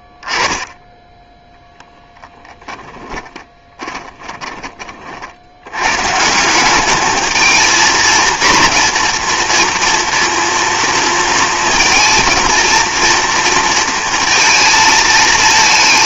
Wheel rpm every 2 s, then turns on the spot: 10, 10, 30, 190, 230, 240, 230, 230.
0-4